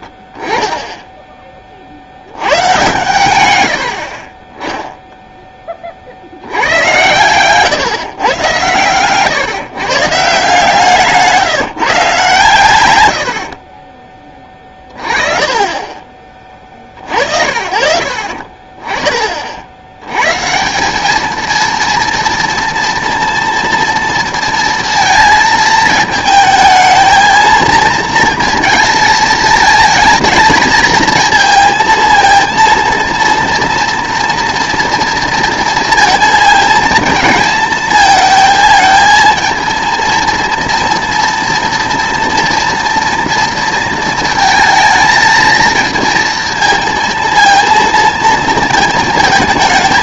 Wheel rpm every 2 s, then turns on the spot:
10, 120, 10, 90, 110, 170, 120, 20, 50, 30, 180, 230, 230, 220, 220, 230, 230, 230, 220, 220, 230, 240, 230, 230, 220.
none